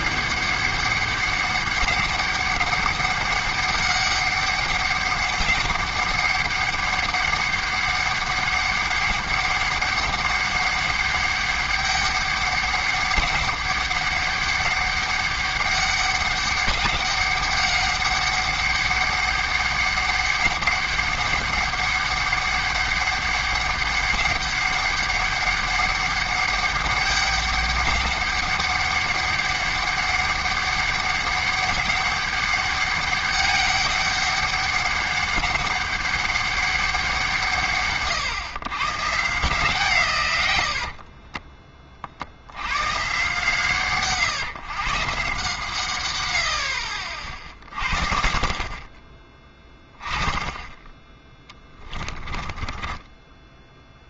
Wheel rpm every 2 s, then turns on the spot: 200, 200, 200, 200, 200, 200, 200, 200, 200, 200, 200, 200, 200, 200, 200, 200, 200, 200, 200, 130, 90, 100, 130, 80, 40, 10, 10.
46-48 52-54